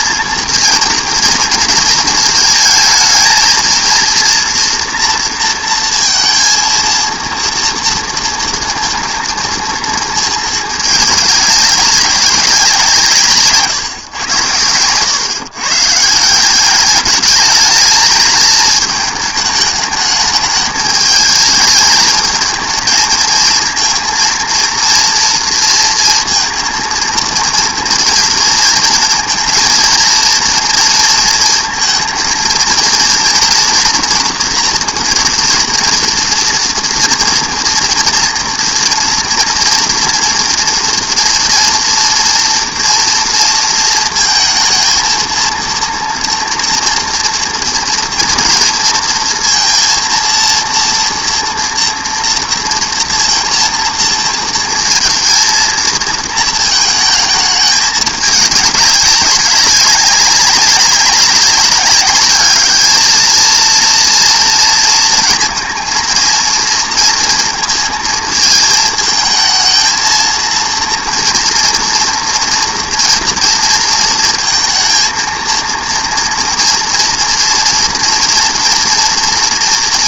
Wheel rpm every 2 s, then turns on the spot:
230, 220, 230, 230, 230, 220, 180, 110, 200, 220, 210, 230, 230, 230, 230, 230, 230, 230, 230, 230, 230, 230, 220, 230, 230, 230, 230, 220, 220, 200, 190, 210, 230, 230, 220, 230, 230, 220, 230, 240.
none